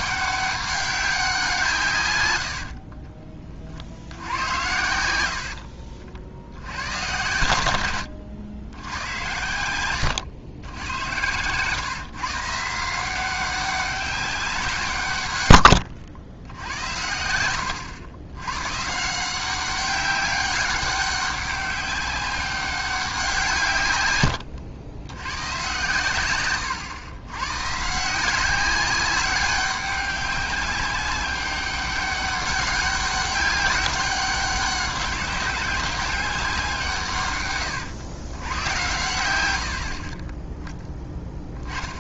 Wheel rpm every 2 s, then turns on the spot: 200, 70, 90, 100, 100, 90, 160, 180, 80, 120, 200, 200, 100, 110, 190, 200, 200, 190, 180, 110, 10.
2-4 26-28